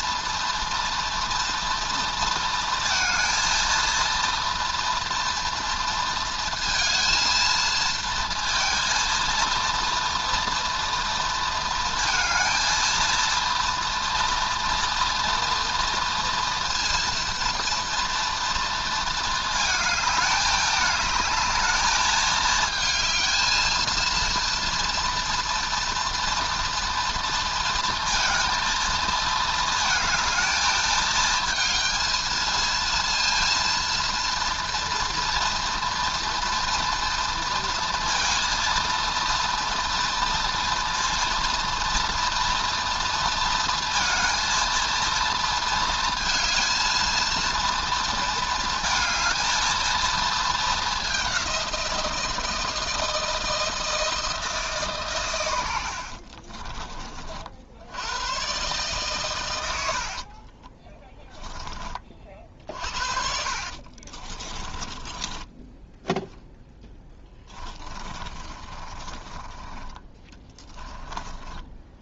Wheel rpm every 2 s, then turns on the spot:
230, 230, 230, 230, 230, 230, 220, 240, 230, 230, 210, 220, 230, 240, 230, 220, 230, 230, 230, 230, 230, 230, 230, 230, 220, 220, 160, 150, 30, 130, 20, 50, 20, 10, 30, 20.
60-72